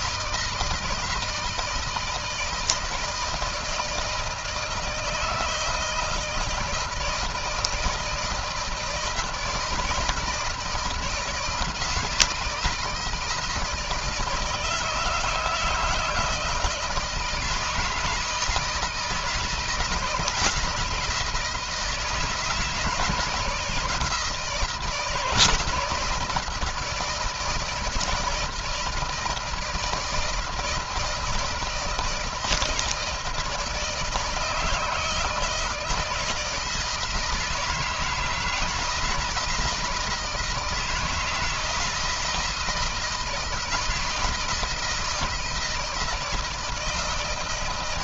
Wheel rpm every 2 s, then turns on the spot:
160, 160, 160, 160, 160, 170, 170, 160, 160, 160, 160, 160, 160, 160, 160, 160, 160, 160, 160, 170, 160, 170, 160, 160.
none